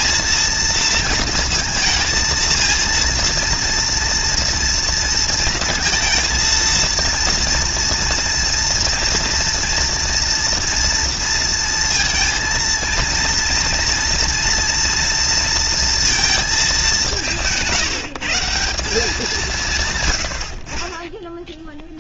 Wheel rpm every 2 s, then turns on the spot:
230, 230, 230, 230, 230, 230, 230, 230, 210, 170, 50.
none